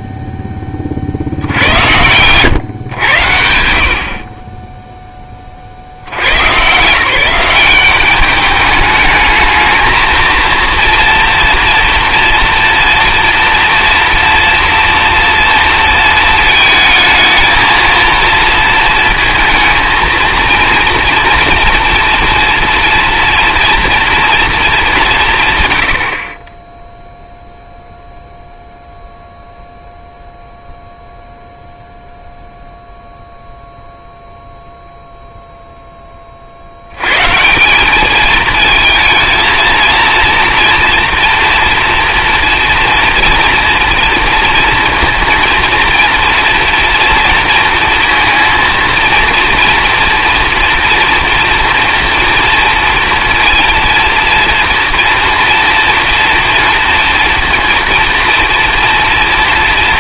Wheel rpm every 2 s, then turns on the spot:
20, 110, 20, 140, 210, 230, 230, 230, 220, 230, 230, 230, 220, 20, 0, 0, 0, 0, 60, 220, 230, 230, 230, 230, 230, 230, 230, 230, 240, 230.
none